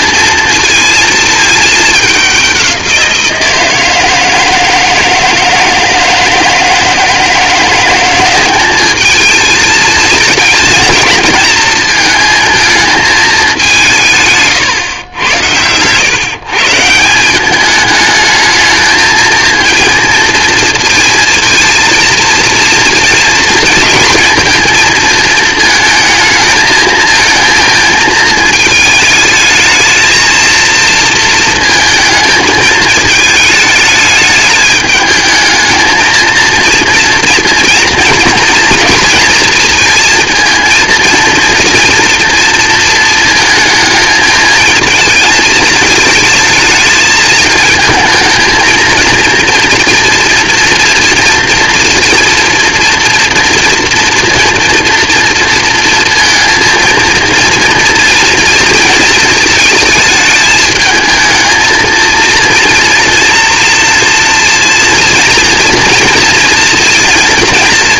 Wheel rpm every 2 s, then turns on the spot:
230, 190, 170, 160, 190, 220, 220, 150, 140, 220, 230, 230, 230, 220, 220, 230, 220, 210, 230, 230, 230, 230, 220, 220, 230, 230, 230, 240, 230, 230, 220, 230, 230, 230.
none